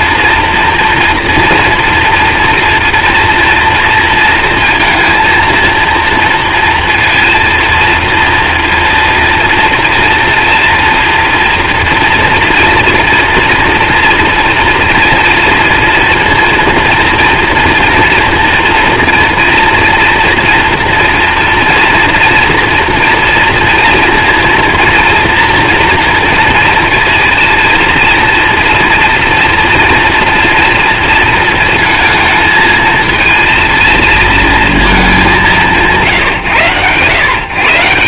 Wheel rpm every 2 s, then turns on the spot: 230, 230, 230, 230, 230, 230, 230, 240, 230, 240, 230, 240, 230, 230, 230, 230, 220, 200, 120.
none